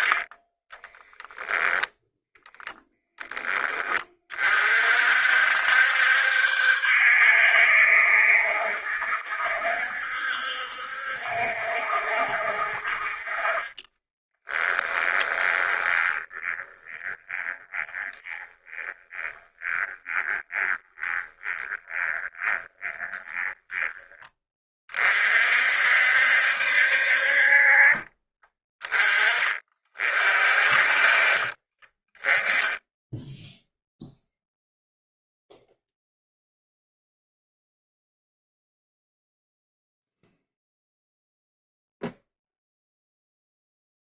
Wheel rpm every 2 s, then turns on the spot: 10, 0, 50, 70, 70, 70, 50, 10, 20, 20, 20, 20, 30, 60, 20, 40, 10, 0, 0, 0, 0, 0.
0-2 14-24